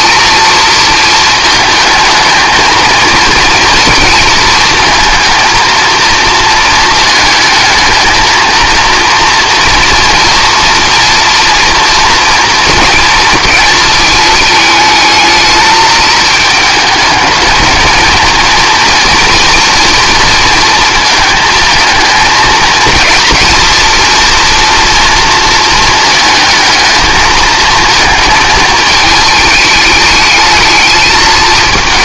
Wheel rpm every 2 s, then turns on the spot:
230, 220, 230, 230, 230, 230, 230, 220, 210, 230, 230, 230, 230, 220, 220, 220.
none